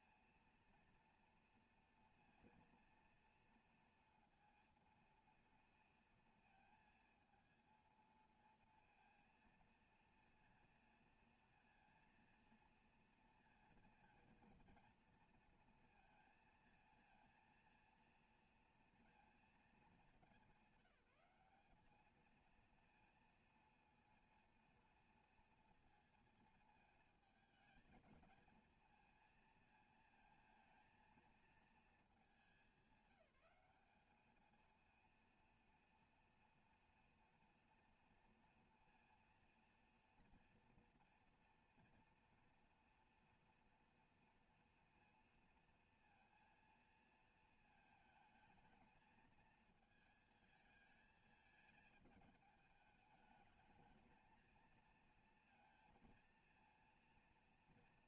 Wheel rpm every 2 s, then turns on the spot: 230, 230, 230, 230, 230, 230, 230, 230, 230, 230, 200, 230, 230, 220, 220, 230, 220, 220, 230, 230, 240, 230, 230, 230, 220, 220, 220, 220, 230.
none